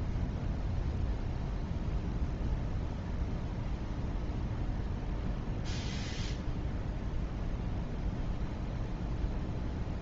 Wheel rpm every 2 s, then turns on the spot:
0, 0, 0, 0, 0.
none